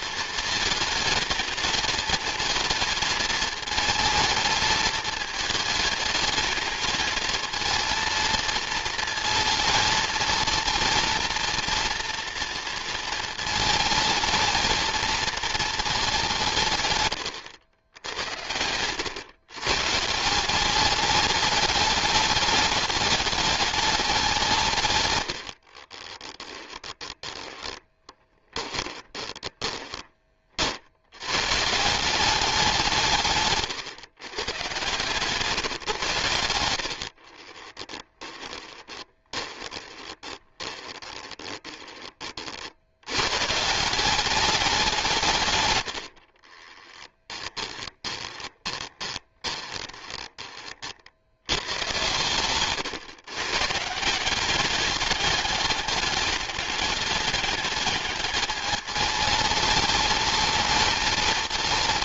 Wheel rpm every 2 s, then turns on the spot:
220, 220, 220, 220, 230, 230, 230, 230, 130, 100, 200, 210, 140, 10, 20, 60, 190, 120, 70, 20, 30, 60, 190, 20, 20, 40, 130, 200, 210, 210, 220.
26-30 36-42 46-50